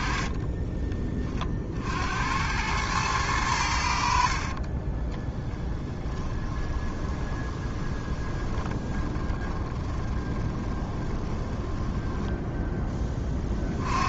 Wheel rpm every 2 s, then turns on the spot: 20, 110, 30, 20, 20, 20, 20.
4-12